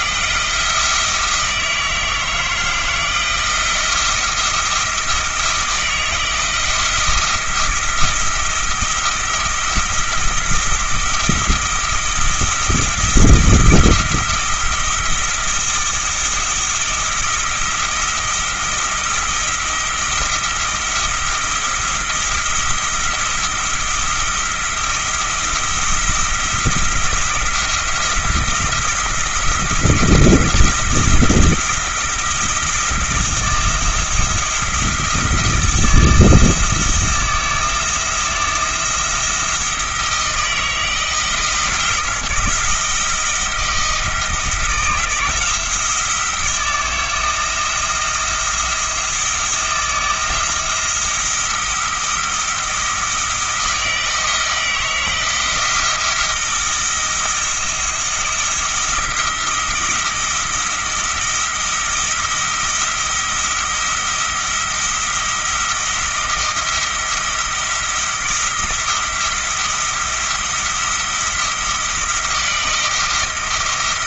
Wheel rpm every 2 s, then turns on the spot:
170, 160, 170, 170, 170, 170, 160, 170, 170, 170, 170, 170, 170, 170, 170, 170, 160, 170, 170, 170, 160, 170, 170, 160, 160, 170, 170, 170, 170, 170, 170, 170, 170, 170, 170, 170, 170.
none